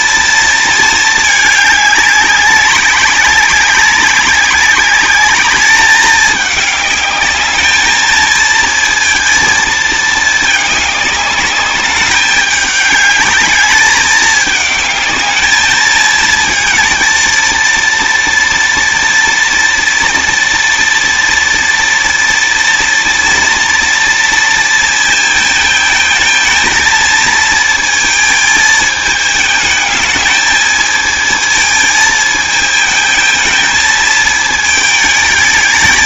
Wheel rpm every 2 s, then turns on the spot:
220, 190, 200, 210, 230, 210, 200, 210, 220, 230, 230, 230, 230, 230, 220, 220, 220, 220.
none